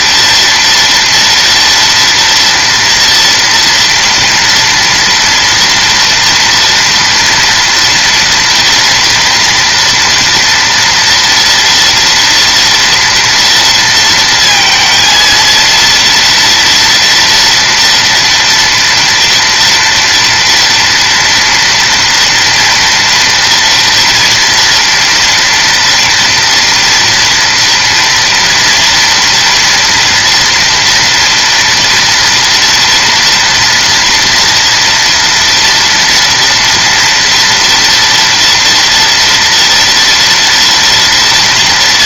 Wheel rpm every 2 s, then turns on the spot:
230, 230, 230, 230, 240, 230, 230, 230, 230, 230, 230, 230, 240, 240, 230, 230, 230, 230, 230, 230, 230.
none